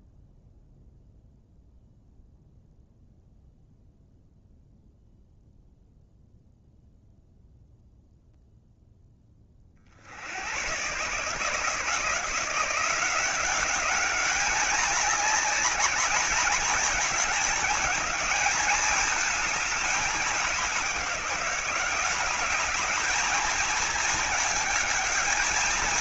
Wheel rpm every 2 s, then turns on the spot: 0, 0, 0, 0, 10, 130, 170, 200, 210, 220, 190, 210, 220.
none